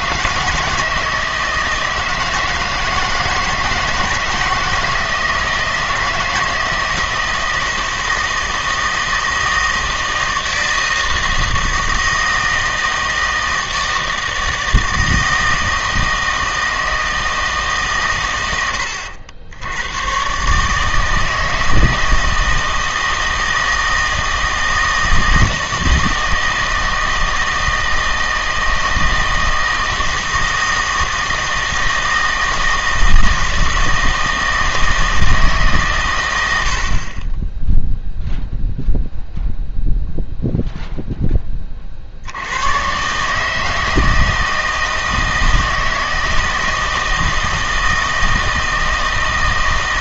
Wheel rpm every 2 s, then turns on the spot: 160, 160, 160, 160, 160, 160, 160, 160, 160, 100, 140, 160, 160, 160, 160, 160, 160, 160, 80, 0, 0, 110, 160, 160, 160.
none